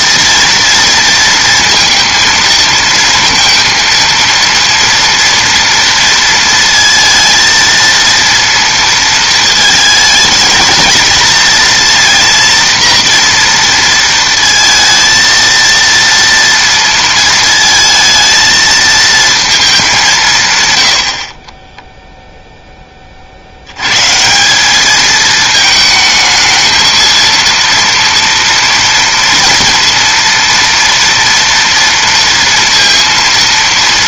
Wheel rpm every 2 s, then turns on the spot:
230, 230, 230, 230, 230, 220, 230, 230, 230, 220, 100, 10, 200, 220, 230, 230, 230.
none